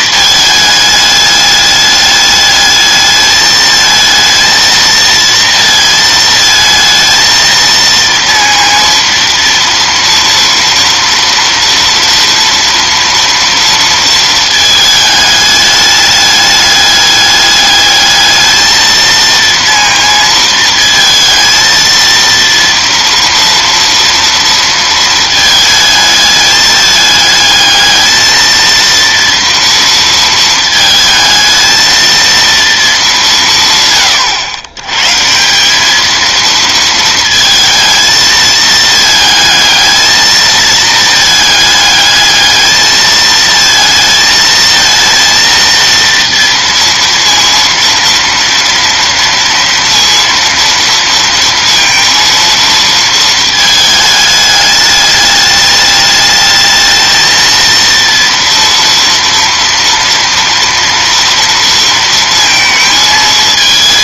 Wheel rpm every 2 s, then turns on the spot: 210, 210, 230, 220, 230, 230, 230, 220, 200, 220, 230, 230, 230, 210, 230, 220, 220, 110, 220, 220, 220, 220, 220, 230, 230, 230, 230, 210, 220, 230, 230, 220.
none